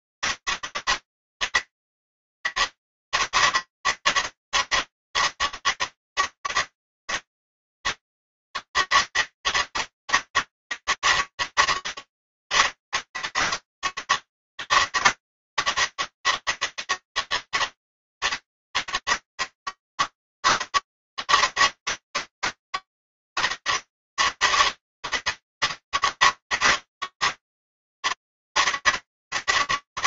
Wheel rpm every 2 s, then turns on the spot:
200, 200, 200, 200, 200, 200, 200, 200, 200, 200, 200, 200, 200, 200, 200.
none